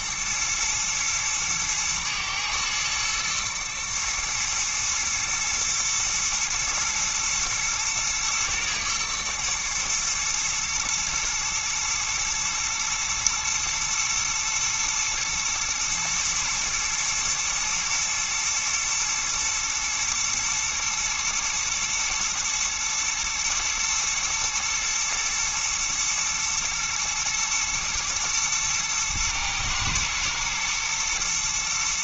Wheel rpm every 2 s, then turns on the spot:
110, 120, 120, 120, 120, 110, 110, 110, 110, 110, 110, 120, 110, 110, 110, 120.
none